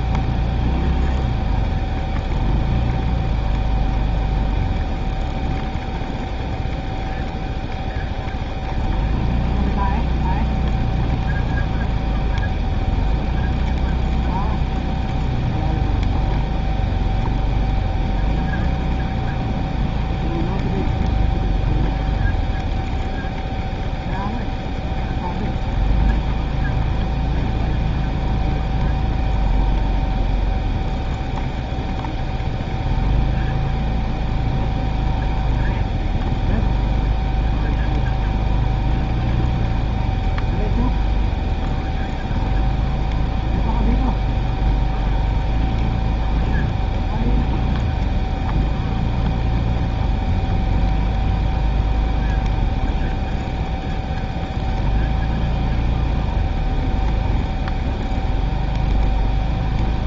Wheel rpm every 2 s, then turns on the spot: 0, 0, 0, 0, 0, 0, 0, 0, 0, 0, 0, 0, 0, 0, 0, 0, 0, 0, 0, 0, 0, 0, 0, 0, 0, 0, 0, 0, 0, 0.
none